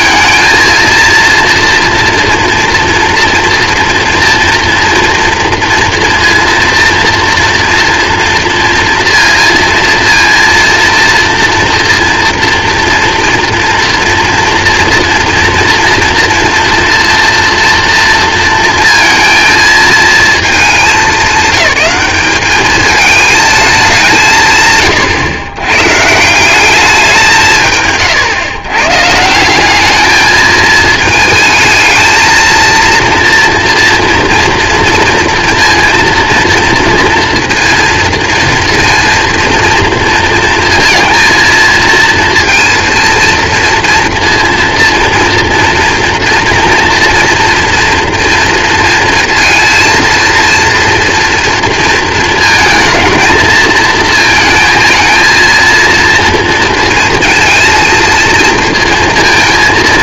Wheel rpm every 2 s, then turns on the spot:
220, 230, 230, 230, 230, 230, 230, 230, 230, 230, 210, 210, 130, 190, 130, 210, 230, 230, 230, 230, 230, 230, 240, 240, 230, 230, 230, 220, 230, 230.
none